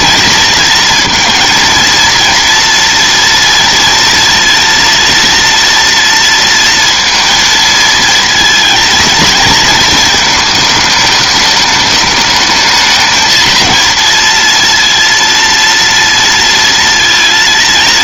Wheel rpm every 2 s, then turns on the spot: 230, 230, 230, 230, 230, 210, 220, 230, 230.
none